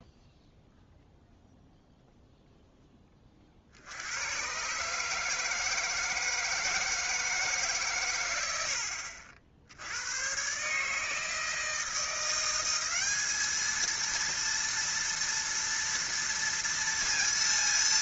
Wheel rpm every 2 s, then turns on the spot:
0, 20, 150, 160, 70, 150, 200, 230, 230.
8-10